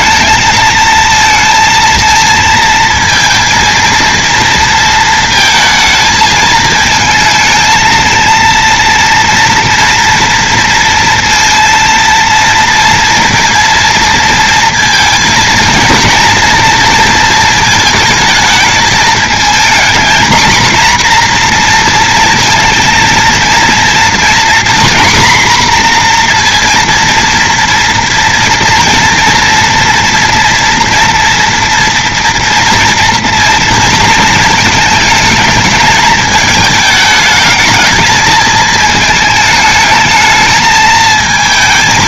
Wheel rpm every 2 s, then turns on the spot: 220, 230, 230, 220, 230, 230, 230, 230, 230, 220, 240, 230, 240, 230, 230, 230, 240, 220, 210, 220, 220.
none